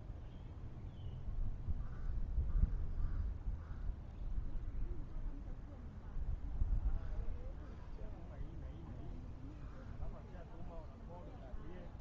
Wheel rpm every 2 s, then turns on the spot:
0, 0, 0, 0, 0, 0.
none